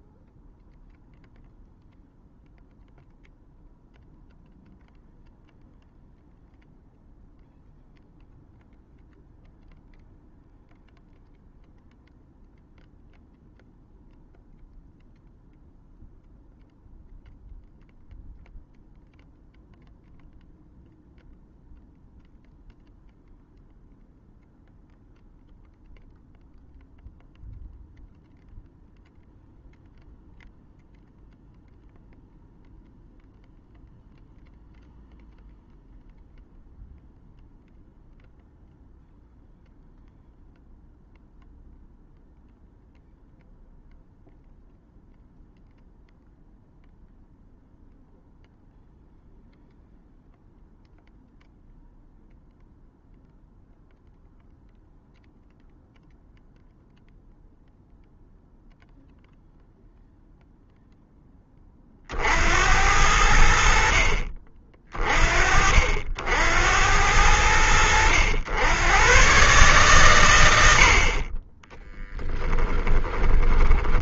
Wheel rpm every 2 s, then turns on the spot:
0, 0, 0, 0, 0, 0, 0, 0, 0, 0, 0, 0, 0, 0, 0, 0, 0, 0, 0, 0, 0, 0, 0, 0, 0, 0, 0, 0, 0, 0, 10, 70, 40, 70, 110, 50, 10.
72-74